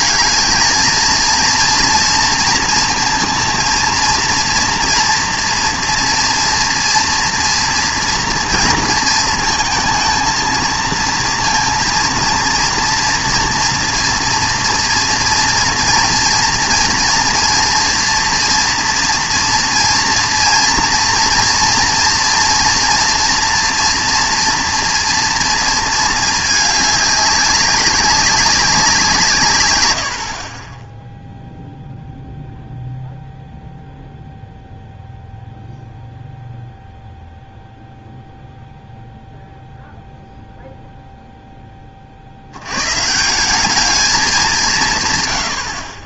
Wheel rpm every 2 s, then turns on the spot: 220, 230, 230, 230, 230, 230, 230, 230, 230, 240, 230, 230, 230, 210, 190, 30, 0, 0, 0, 0, 0, 110, 190.
none